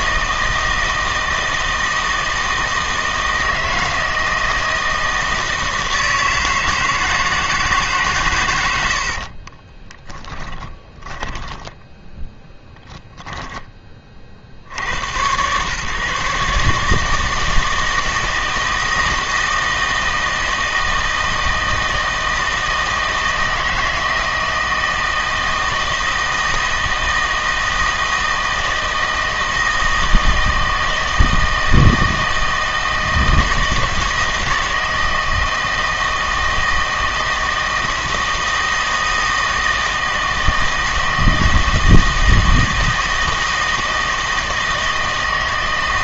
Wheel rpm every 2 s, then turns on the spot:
160, 160, 160, 160, 80, 10, 10, 90, 150, 160, 160, 160, 160, 160, 160, 160, 160, 160, 160, 160, 160, 160, 160.
10-14